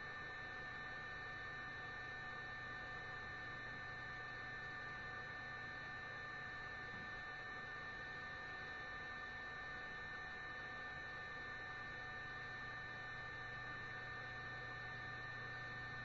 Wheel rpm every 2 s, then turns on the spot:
0, 0, 0, 0, 0, 0, 0, 0.
none